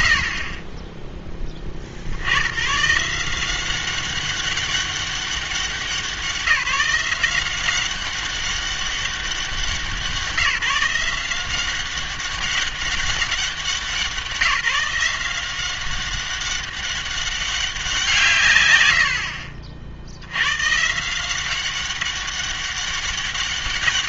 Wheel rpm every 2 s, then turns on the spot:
50, 110, 200, 180, 190, 170, 200, 180, 200, 110, 130, 200.
none